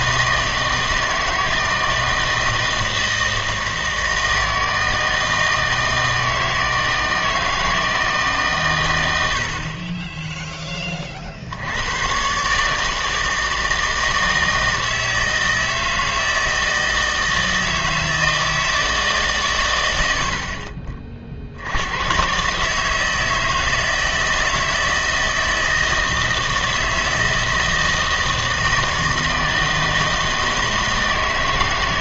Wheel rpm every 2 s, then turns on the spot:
160, 160, 160, 160, 130, 10, 140, 160, 160, 160, 40, 150, 160, 160, 160, 160.
none